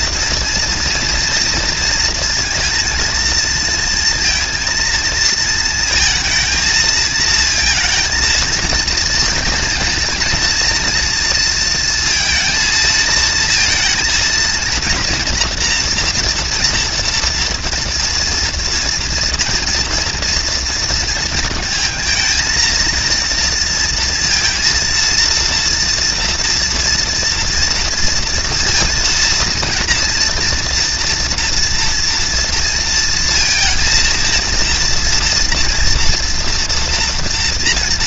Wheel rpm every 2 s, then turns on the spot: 230, 230, 220, 220, 230, 230, 230, 230, 230, 230, 230, 230, 230, 230, 230, 230, 230, 230, 230.
none